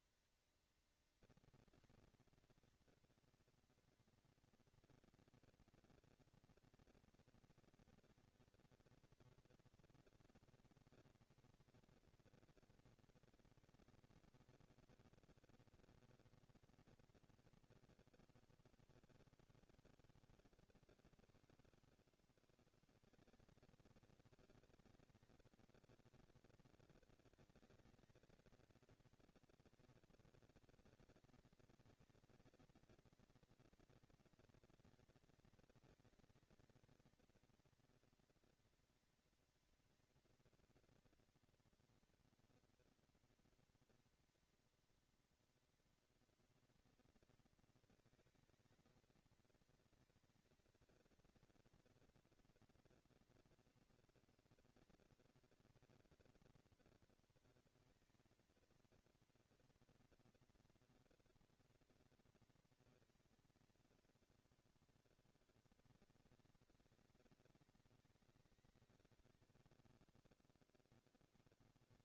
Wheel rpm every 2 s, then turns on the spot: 230, 240, 230, 230, 230, 230, 230, 230, 220, 170, 110, 160, 220, 220, 230, 230, 230, 230, 230, 230, 230, 230, 230, 230, 220, 230, 230, 230, 230, 230, 230, 220, 200, 190, 180, 70.
none